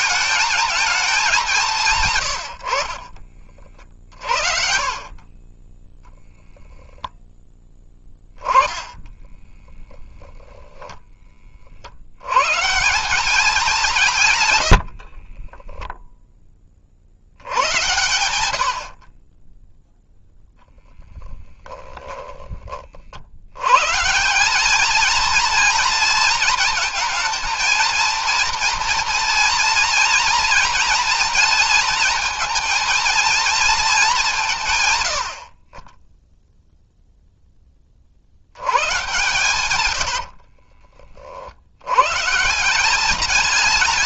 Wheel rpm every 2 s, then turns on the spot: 220, 80, 50, 0, 20, 20, 180, 40, 60, 30, 10, 70, 230, 220, 230, 230, 230, 90, 0, 120, 50, 190.
2-4 8-10 14-16 38-40